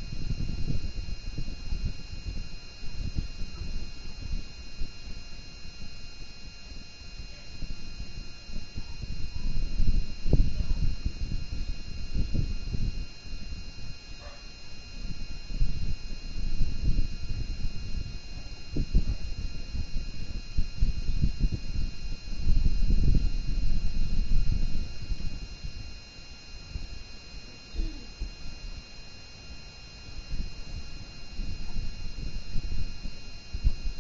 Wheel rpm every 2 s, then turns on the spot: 0, 0, 0, 0, 0, 0, 0, 0, 0, 0, 0, 0, 0, 0, 0, 0, 0.
none